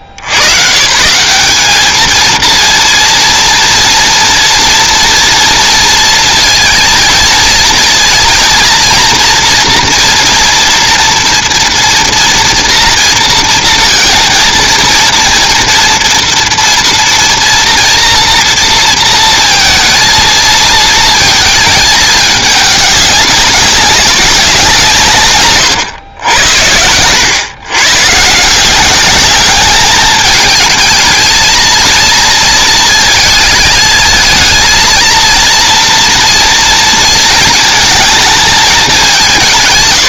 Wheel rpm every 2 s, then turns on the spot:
110, 230, 230, 230, 230, 230, 230, 230, 230, 230, 230, 210, 190, 110, 160, 210, 230, 220, 230, 220.
none